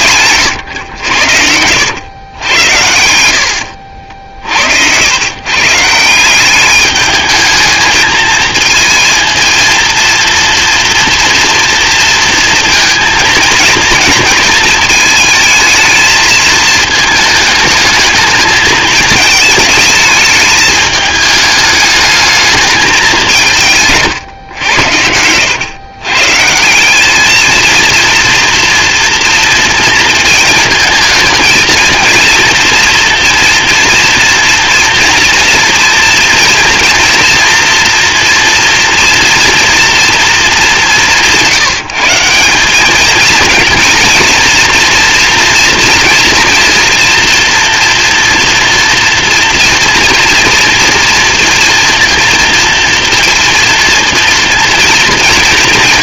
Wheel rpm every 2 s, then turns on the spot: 120, 90, 70, 200, 220, 230, 230, 220, 220, 220, 210, 220, 110, 170, 230, 220, 230, 230, 230, 230, 210, 200, 230, 230, 230, 230, 230, 230.
none